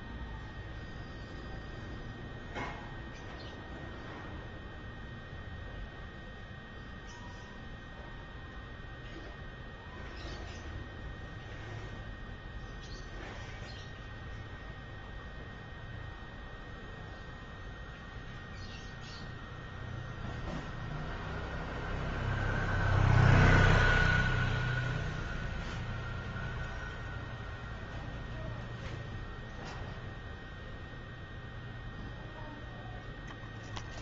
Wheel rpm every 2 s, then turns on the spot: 0, 0, 0, 0, 0, 0, 0, 0, 0, 0, 0, 0, 0, 0, 0, 0, 0.
none